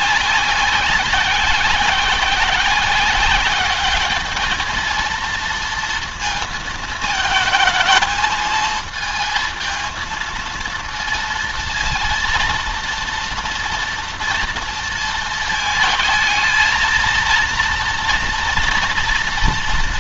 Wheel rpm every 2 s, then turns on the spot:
190, 190, 220, 230, 220, 230, 230, 230, 220, 230.
none